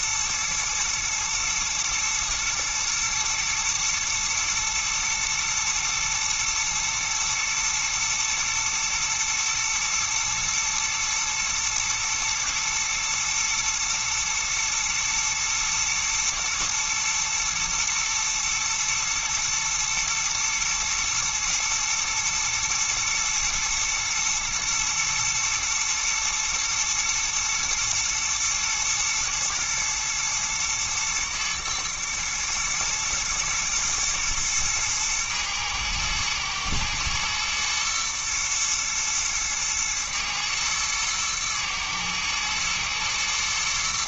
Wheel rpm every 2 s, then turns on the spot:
110, 110, 120, 120, 110, 110, 110, 110, 110, 120, 120, 110, 120, 120, 120, 120, 120, 110, 110, 120, 110, 110.
none